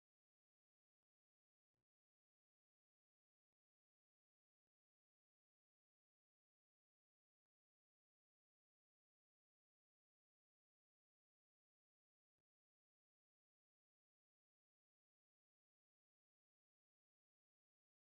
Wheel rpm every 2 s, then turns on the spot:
0, 0, 0, 0, 0, 0, 0, 0, 0.
none